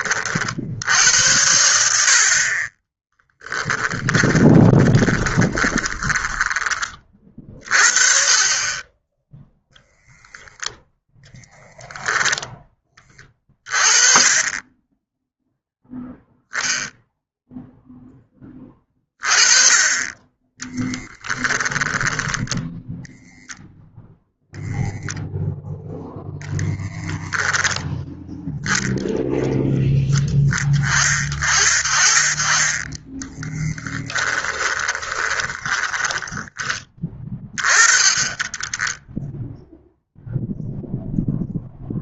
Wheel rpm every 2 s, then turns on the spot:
70, 20, 30, 30, 20, 10, 20, 10, 0, 20, 10, 0, 0, 10, 0, 20, 20, 20, 20, 10, 0.
2-6 34-36